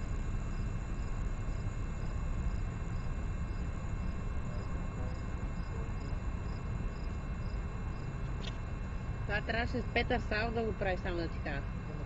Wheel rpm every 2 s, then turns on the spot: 0, 0, 0, 0, 0, 0.
none